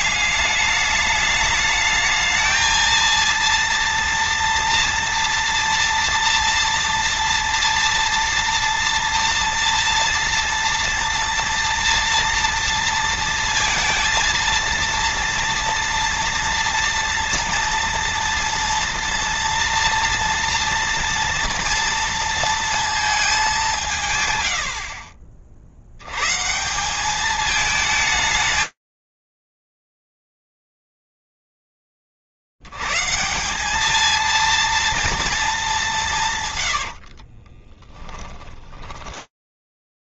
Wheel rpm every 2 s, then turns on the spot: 200, 220, 230, 230, 230, 230, 230, 230, 230, 230, 230, 230, 90, 160, 210, 30, 20, 200, 210, 30.
38-40